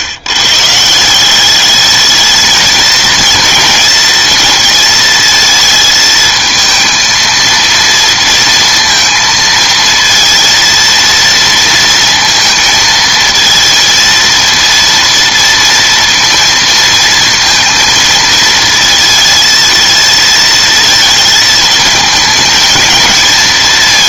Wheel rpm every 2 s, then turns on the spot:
160, 220, 230, 230, 230, 230, 230, 230, 230, 230, 230, 220.
none